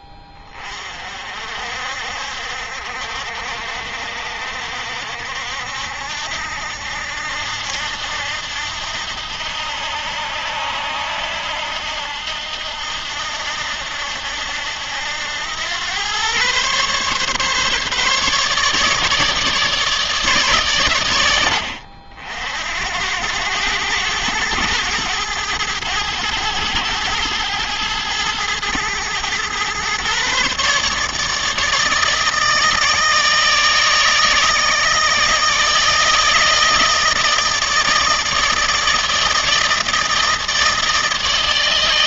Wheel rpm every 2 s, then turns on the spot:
40, 60, 60, 80, 80, 80, 80, 90, 140, 150, 110, 90, 110, 110, 110, 150, 160, 160, 160, 160, 160.
none